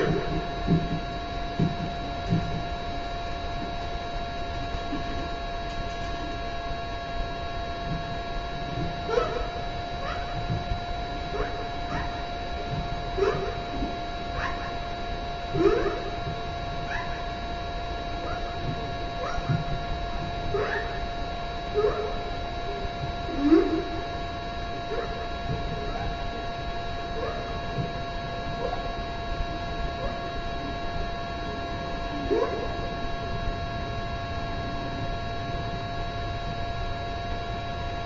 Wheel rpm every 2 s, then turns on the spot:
0, 0, 0, 0, 0, 0, 0, 0, 0, 0, 0, 0, 0, 0, 0, 0, 0, 0, 0.
none